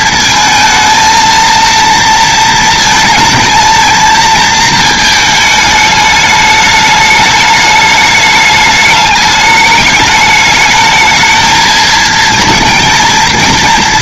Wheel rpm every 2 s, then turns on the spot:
230, 230, 220, 210, 210, 220, 230.
none